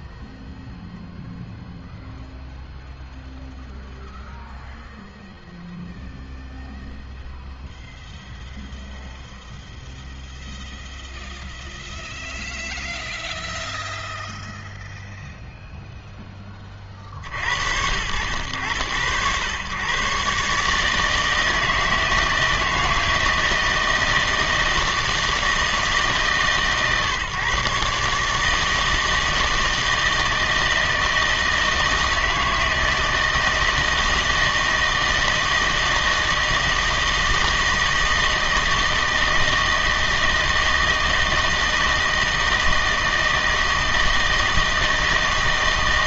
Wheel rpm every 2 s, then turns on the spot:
0, 0, 0, 0, 0, 0, 0, 0, 30, 90, 140, 160, 160, 140, 160, 160, 160, 160, 160, 160, 160, 160, 160.
none